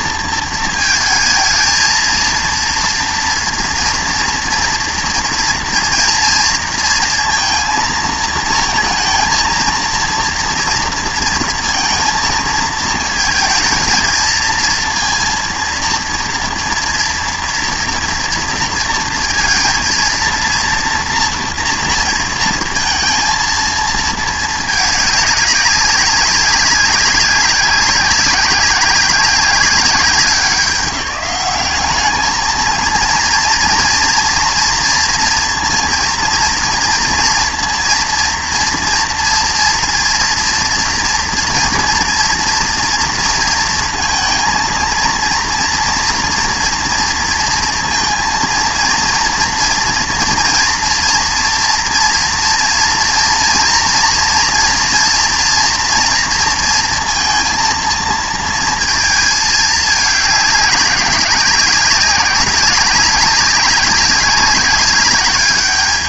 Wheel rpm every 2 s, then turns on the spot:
230, 230, 230, 230, 230, 230, 230, 230, 230, 230, 230, 230, 210, 200, 190, 190, 220, 230, 230, 230, 230, 230, 220, 230, 230, 240, 230, 240, 230, 230, 200, 190, 190.
none